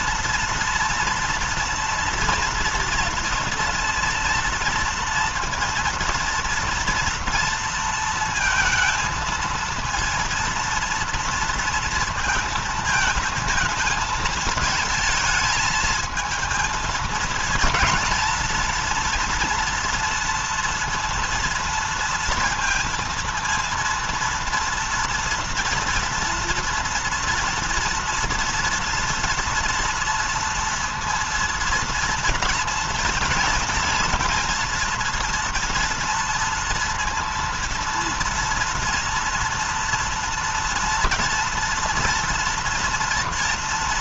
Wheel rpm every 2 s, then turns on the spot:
230, 230, 230, 230, 230, 230, 230, 220, 220, 230, 230, 230, 230, 230, 240, 230, 230, 230, 230, 230, 240, 230.
none